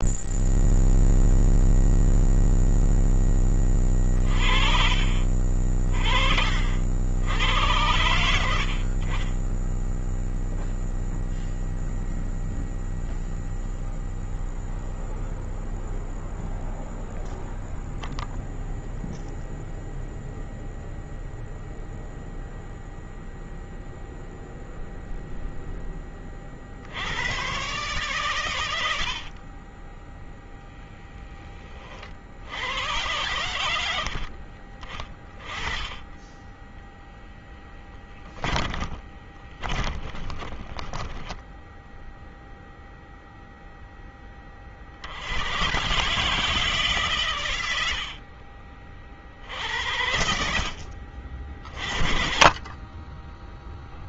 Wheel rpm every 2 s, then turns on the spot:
0, 0, 40, 50, 80, 0, 0, 0, 0, 0, 0, 0, 0, 40, 120, 10, 70, 40, 10, 20, 10, 0, 20, 150, 40, 70, 40.
4-6 8-10 30-32 38-42 48-50